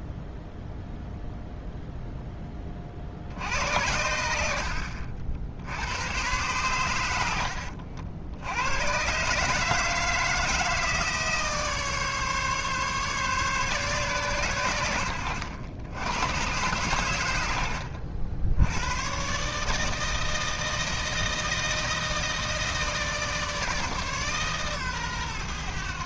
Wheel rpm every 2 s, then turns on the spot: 0, 20, 70, 110, 100, 160, 140, 100, 120, 100, 160, 160, 130.
4-6